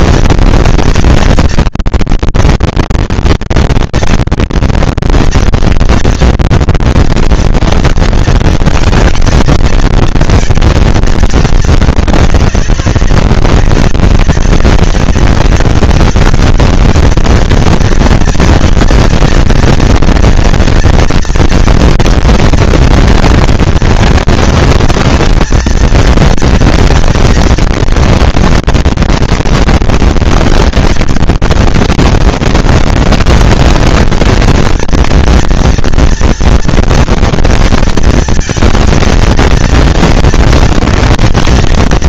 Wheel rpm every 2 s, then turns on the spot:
230, 230, 230, 240, 230, 220, 200, 190, 210, 220, 230, 230, 230, 230, 230, 230, 230, 230, 230, 230, 240.
none